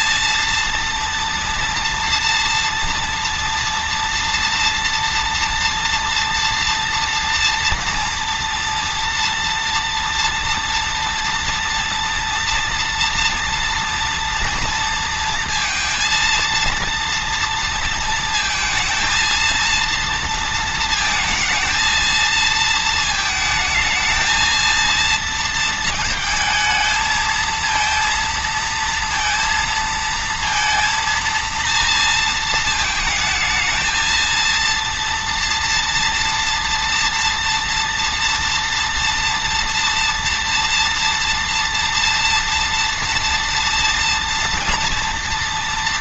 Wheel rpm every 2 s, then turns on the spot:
230, 230, 230, 230, 230, 230, 230, 230, 230, 230, 230, 220, 230, 220, 230, 230, 220, 230, 230, 230, 230, 230, 230.
none